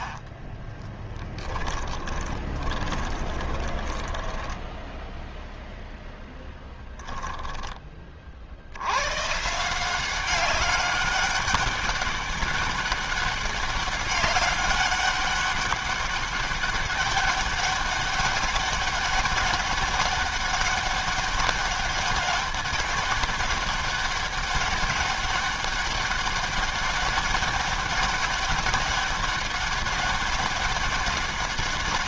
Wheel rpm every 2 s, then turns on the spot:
20, 20, 10, 10, 70, 190, 200, 200, 200, 200, 200, 200, 200, 200, 200, 200.
0-8